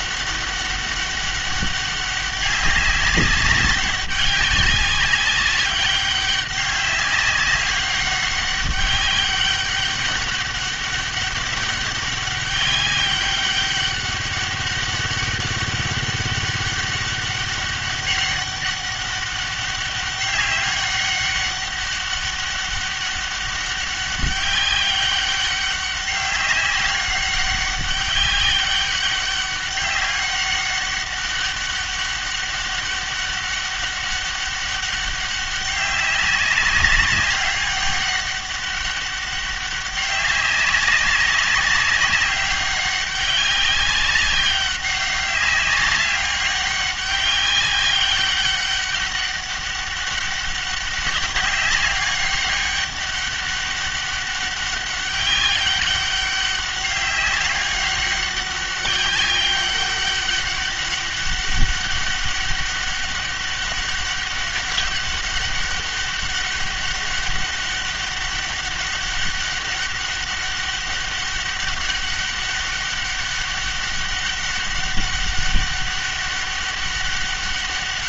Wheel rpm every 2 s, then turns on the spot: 200, 200, 200, 200, 200, 200, 200, 200, 200, 200, 200, 200, 200, 200, 200, 200, 200, 200, 200, 200, 190, 190, 190, 200, 200, 190, 200, 200, 200, 200, 200, 200, 200, 200, 200, 200, 200, 200, 200.
none